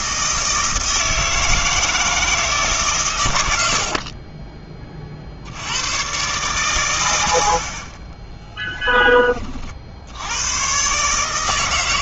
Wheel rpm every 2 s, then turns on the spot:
160, 150, 30, 120, 20, 120.
8-10